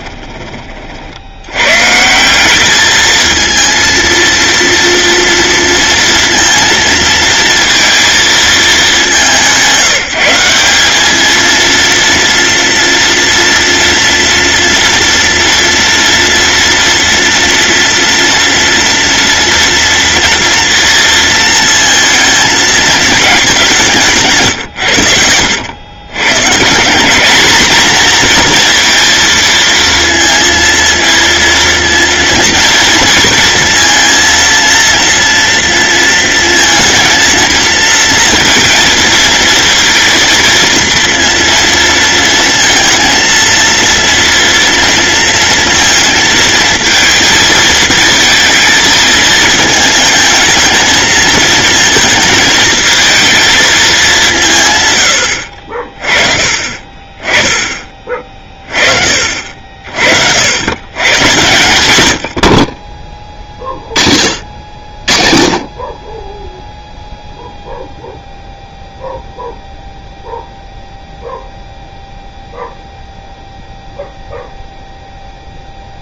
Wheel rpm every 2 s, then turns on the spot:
40, 210, 230, 230, 200, 200, 230, 230, 230, 230, 230, 220, 110, 170, 240, 230, 230, 230, 230, 230, 230, 230, 230, 230, 220, 220, 220, 140, 30, 40, 110, 40, 50, 0, 0, 0, 0, 0.
62-64